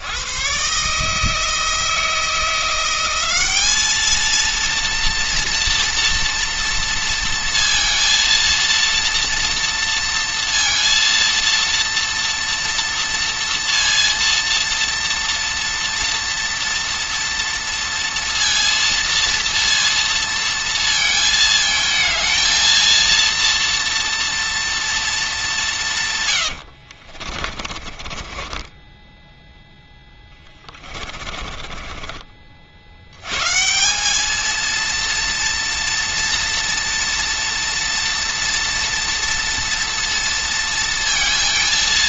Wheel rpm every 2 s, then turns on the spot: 80, 160, 220, 230, 230, 230, 230, 230, 240, 230, 230, 220, 230, 130, 30, 20, 40, 220, 230, 230, 230.
28-32